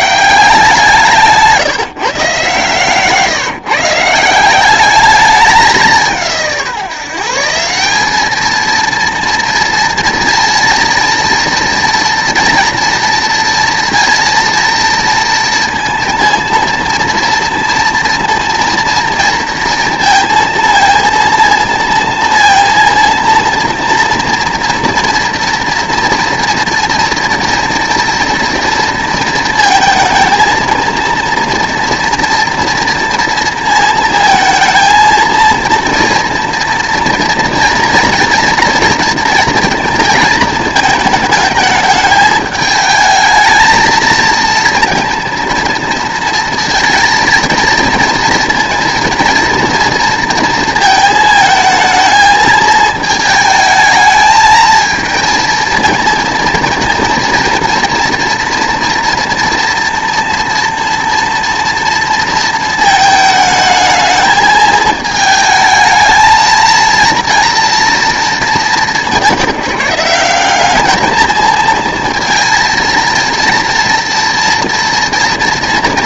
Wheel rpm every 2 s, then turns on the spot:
170, 140, 190, 160, 220, 230, 230, 230, 230, 230, 230, 230, 240, 240, 230, 230, 230, 230, 230, 230, 220, 220, 230, 230, 230, 230, 220, 220, 230, 240, 230, 220, 220, 230, 190, 200, 230, 230.
none